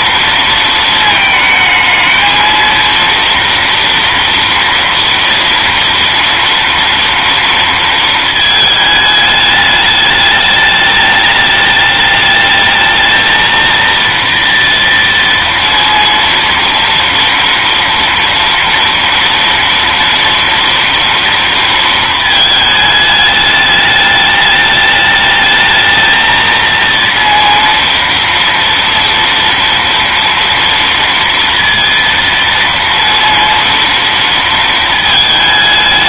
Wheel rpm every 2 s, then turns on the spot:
230, 230, 230, 230, 220, 210, 220, 230, 230, 230, 230, 220, 210, 230, 230, 230, 230, 220.
none